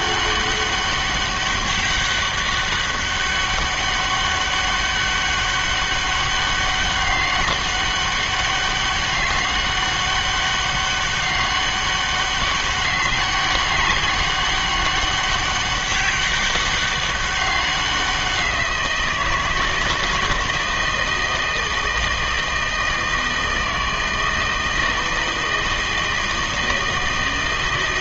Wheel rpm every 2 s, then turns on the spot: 200, 200, 200, 200, 200, 200, 200, 200, 200, 180, 160, 160, 160, 160.
none